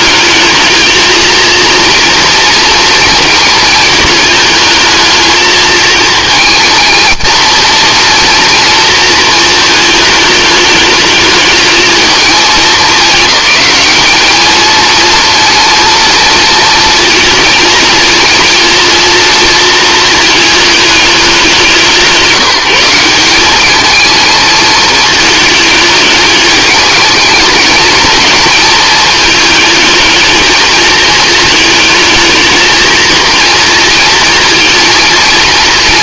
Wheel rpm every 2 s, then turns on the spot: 220, 230, 220, 220, 230, 210, 210, 230, 230, 230, 210, 180, 220, 210, 220, 220, 220, 230.
none